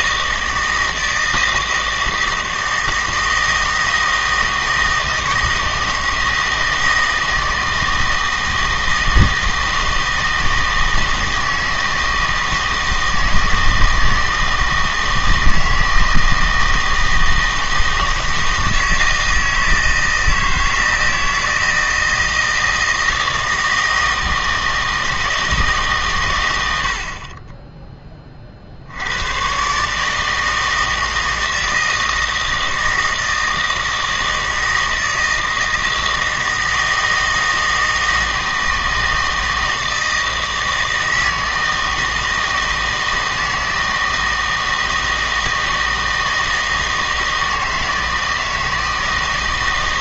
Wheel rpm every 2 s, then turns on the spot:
160, 160, 160, 160, 160, 160, 160, 160, 160, 160, 160, 160, 160, 80, 60, 160, 160, 160, 160, 160, 160, 160, 160, 160, 160.
none